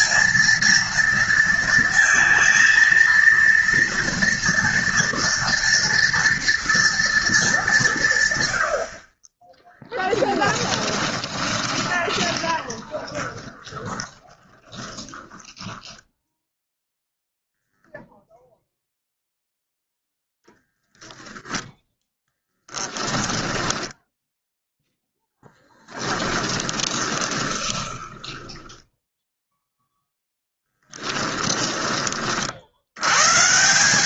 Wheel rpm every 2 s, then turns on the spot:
230, 230, 230, 240, 70, 10, 10, 20, 0, 0, 0, 20, 0, 20, 10, 10, 80.
10-16 22-24 26-32